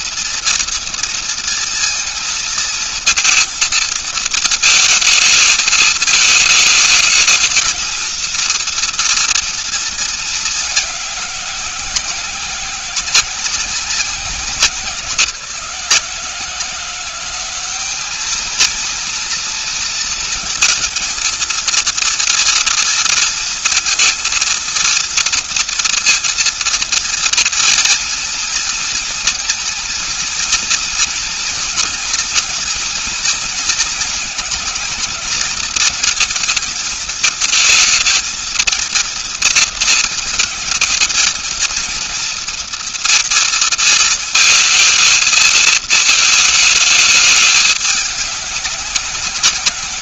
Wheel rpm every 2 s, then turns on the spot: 230, 230, 220, 220, 230, 190, 190, 170, 190, 230, 220, 230, 230, 230, 230, 240, 230, 220, 220, 230, 220, 230, 220, 210, 190.
none